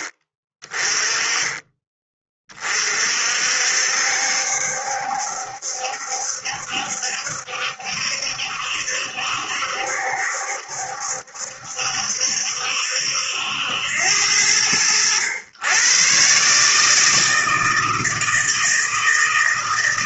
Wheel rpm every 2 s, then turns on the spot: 20, 40, 70, 70, 70, 70, 70, 80, 140, 160.
none